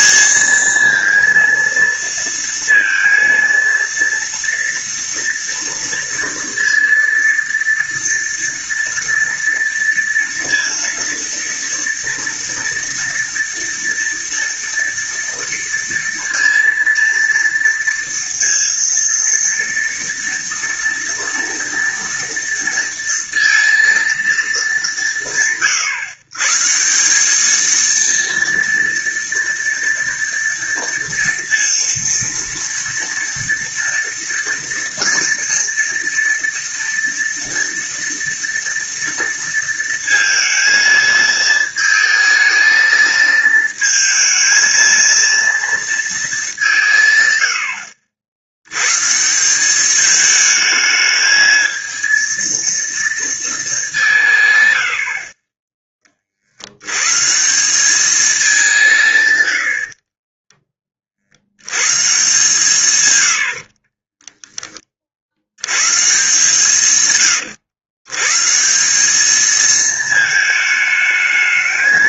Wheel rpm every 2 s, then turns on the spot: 230, 230, 230, 230, 230, 230, 230, 230, 230, 230, 230, 230, 210, 150, 230, 230, 230, 230, 230, 230, 230, 220, 230, 190, 100, 220, 230, 110, 70, 190, 20, 130, 20, 160, 150, 220.
none